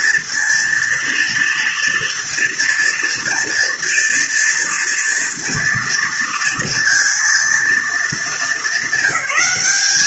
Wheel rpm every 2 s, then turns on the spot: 230, 230, 230, 230, 200.
none